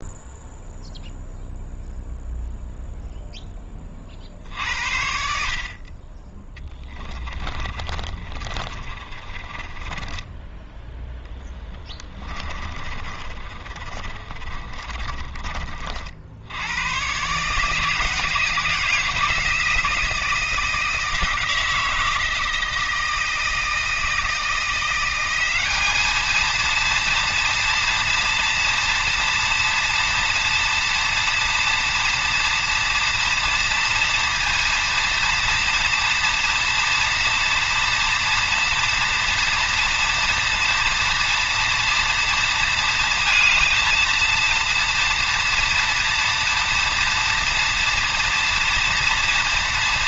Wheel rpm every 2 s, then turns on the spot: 0, 0, 80, 10, 30, 10, 20, 30, 90, 170, 160, 160, 170, 230, 230, 230, 230, 230, 230, 230, 230, 230, 230, 230, 230.
6-16